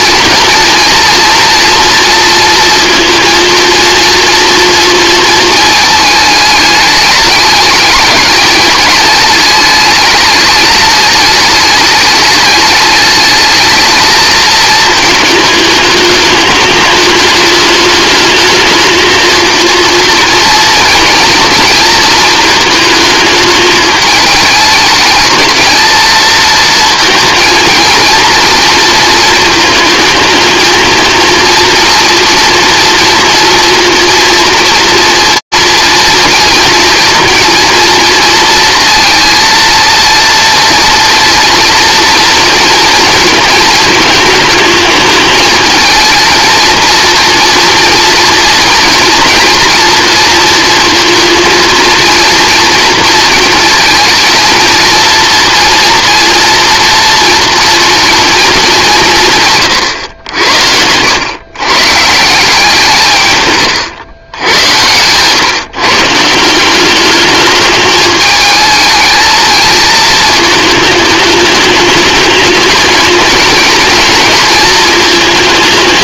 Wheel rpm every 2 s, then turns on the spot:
240, 230, 230, 210, 210, 210, 210, 220, 210, 220, 230, 220, 210, 230, 230, 220, 230, 230, 230, 230, 230, 230, 220, 230, 230, 230, 230, 230, 230, 200, 80, 160, 100, 180, 220, 220, 220, 220.
64-66